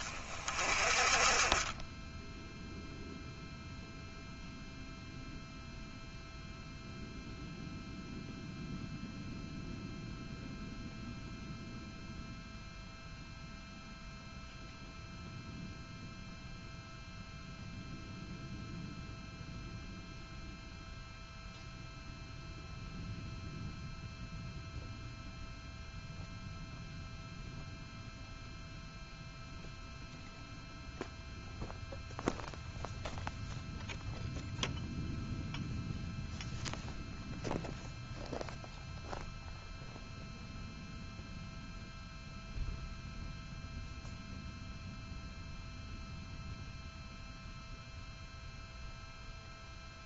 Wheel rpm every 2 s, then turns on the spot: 30, 0, 0, 0, 0, 0, 0, 0, 0, 0, 0, 0, 0, 0, 0, 0, 0, 0, 0, 0, 0, 0, 0, 0, 0.
none